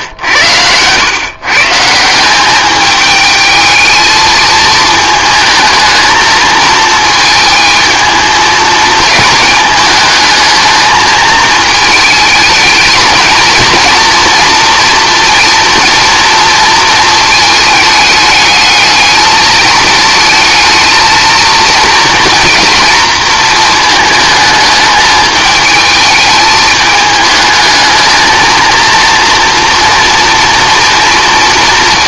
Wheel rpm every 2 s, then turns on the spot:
100, 200, 220, 220, 220, 220, 220, 240, 230, 220, 230, 230, 220, 210, 230, 230.
none